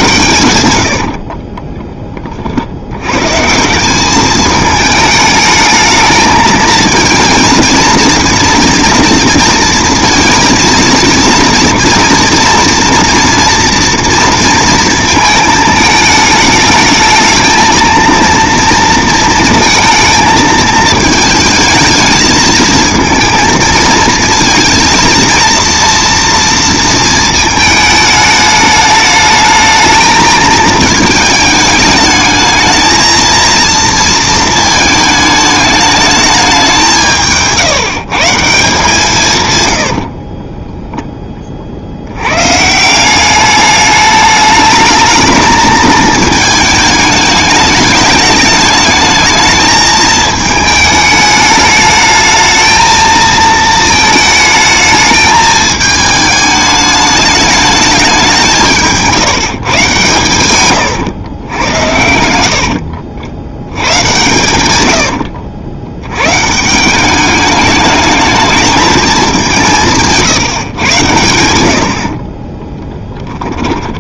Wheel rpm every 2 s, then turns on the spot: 100, 70, 220, 220, 230, 230, 230, 230, 220, 230, 220, 220, 230, 230, 210, 220, 220, 220, 190, 160, 20, 140, 210, 220, 210, 220, 220, 220, 210, 170, 120, 70, 100, 150, 210, 140, 20.
0-2 40-42 60-66 72-74